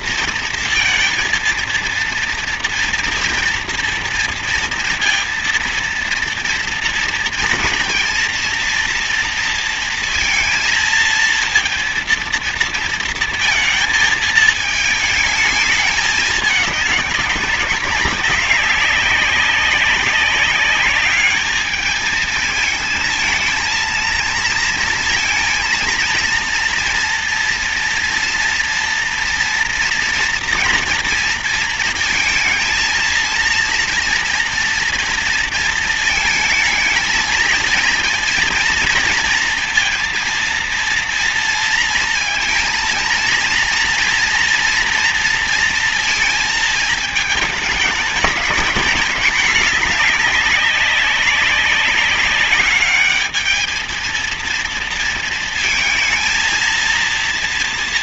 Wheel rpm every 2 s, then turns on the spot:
230, 230, 230, 230, 230, 230, 230, 220, 210, 190, 200, 220, 230, 230, 230, 230, 230, 240, 220, 230, 230, 230, 230, 220, 210, 210, 200, 230, 230.
none